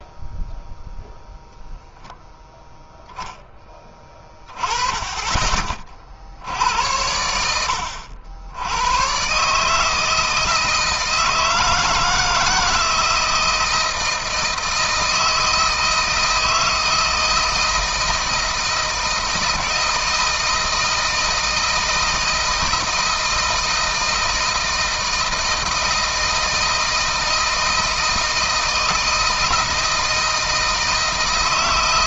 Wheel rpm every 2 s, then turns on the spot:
0, 0, 10, 70, 90, 160, 160, 160, 160, 160, 160, 160, 160, 160, 160, 160.
none